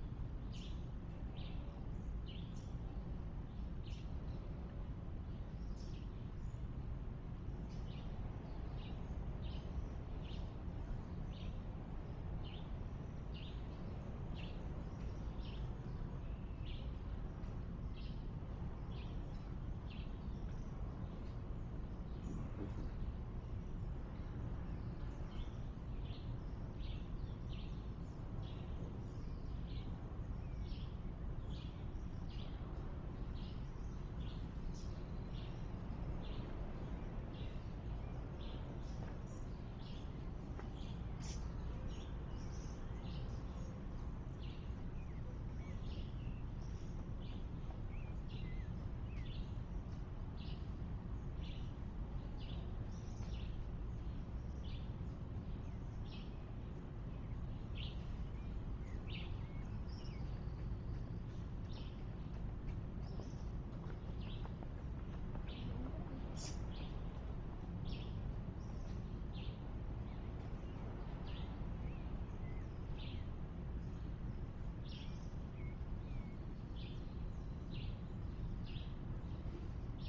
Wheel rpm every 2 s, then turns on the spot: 0, 0, 0, 0, 0, 0, 0, 0, 0, 0, 0, 0, 0, 0, 0, 0, 0, 0, 0, 0, 0, 0, 0, 0, 0, 0, 0, 0, 0, 0, 0, 0, 0, 0, 0, 0, 0, 0, 0, 0.
none